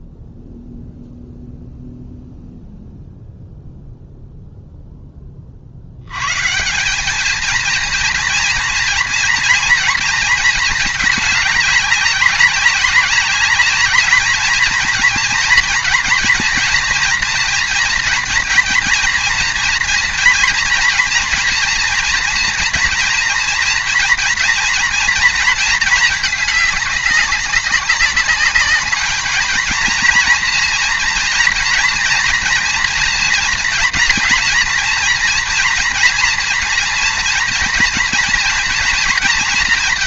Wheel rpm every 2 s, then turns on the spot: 0, 0, 0, 160, 240, 220, 190, 220, 230, 230, 230, 230, 230, 210, 210, 230, 230, 240, 240, 230.
none